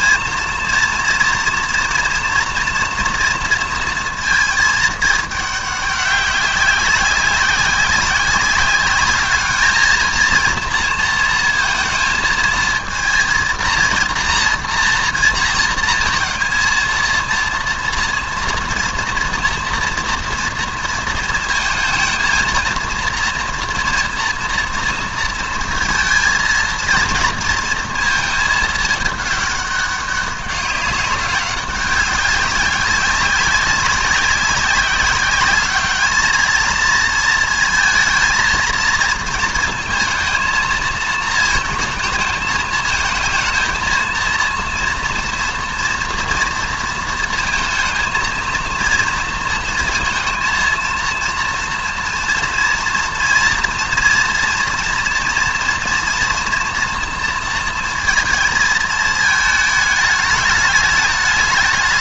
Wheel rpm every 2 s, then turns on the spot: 230, 230, 220, 200, 200, 230, 220, 230, 230, 240, 230, 230, 230, 230, 220, 200, 200, 190, 220, 230, 220, 220, 230, 230, 230, 230, 230, 230, 230, 220, 210.
none